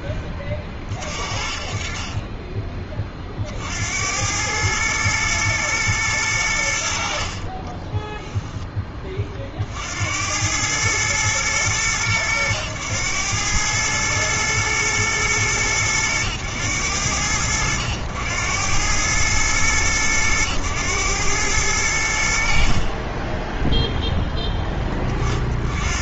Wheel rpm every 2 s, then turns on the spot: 30, 10, 100, 90, 10, 100, 100, 110, 100, 90, 110, 40, 10.
none